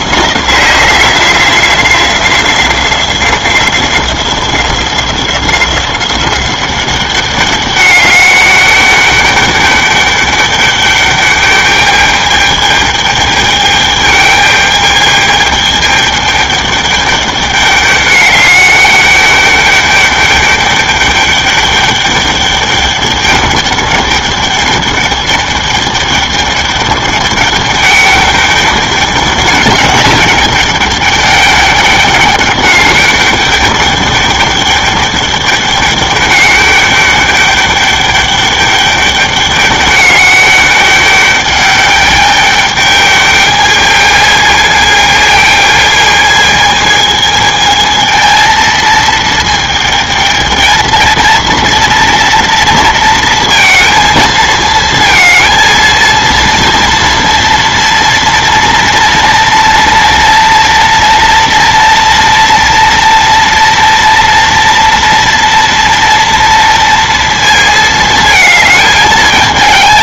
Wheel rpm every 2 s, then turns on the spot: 180, 180, 180, 190, 200, 200, 210, 210, 210, 200, 200, 210, 210, 210, 200, 200, 200, 210, 200, 210, 200, 210, 220, 220, 230, 220, 230, 220, 230, 240, 230, 230, 230, 230, 220.
none